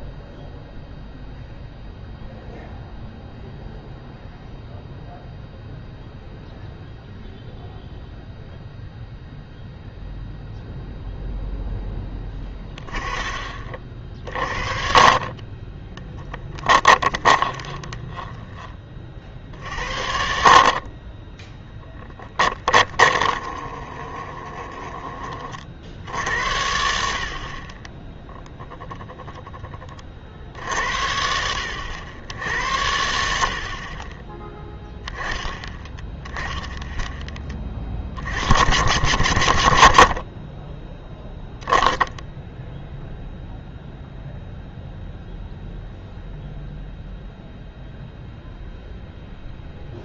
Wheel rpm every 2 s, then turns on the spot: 0, 0, 0, 0, 0, 0, 10, 40, 20, 20, 50, 20, 20, 70, 10, 70, 80, 10, 10, 100, 20, 0, 0, 0, 0.
16-18 22-26 28-30